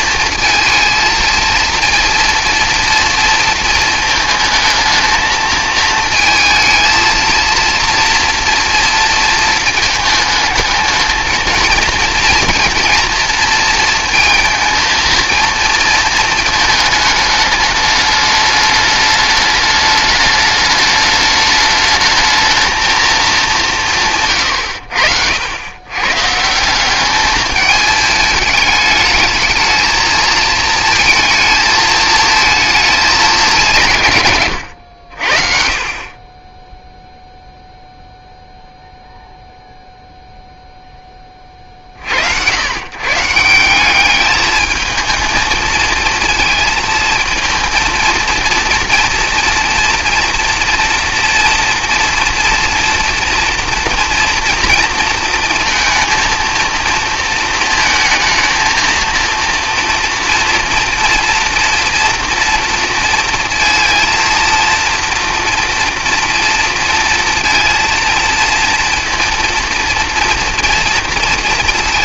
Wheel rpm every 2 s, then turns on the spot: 230, 230, 220, 220, 230, 220, 240, 230, 220, 210, 210, 230, 80, 190, 210, 230, 220, 90, 0, 0, 10, 120, 220, 220, 230, 230, 240, 230, 230, 230, 230, 230, 240, 230, 230, 230.
none